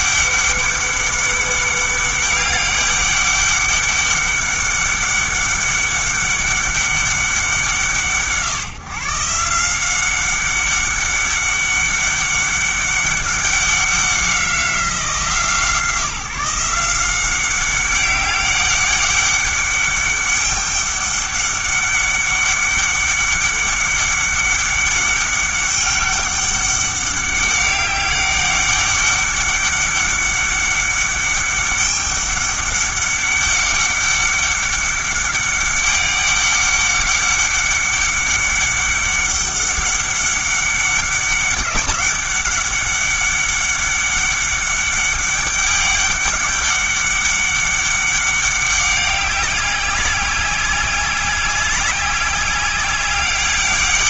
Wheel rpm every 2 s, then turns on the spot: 200, 200, 200, 200, 150, 200, 200, 180, 170, 200, 200, 200, 200, 200, 200, 200, 200, 200, 200, 200, 200, 200, 200, 200, 200, 190, 190.
none